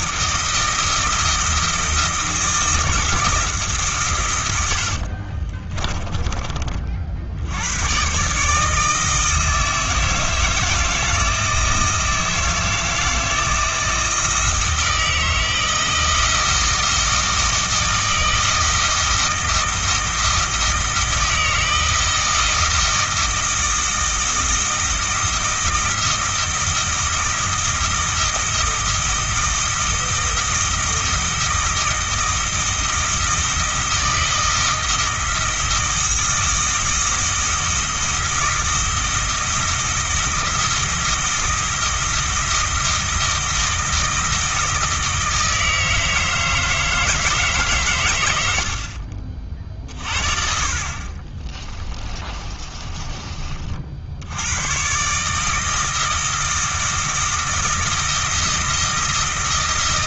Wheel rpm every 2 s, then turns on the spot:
160, 160, 80, 40, 150, 160, 160, 160, 160, 160, 160, 160, 160, 160, 160, 160, 160, 170, 160, 170, 170, 160, 160, 160, 70, 50, 30, 110, 160, 160.
4-6 50-54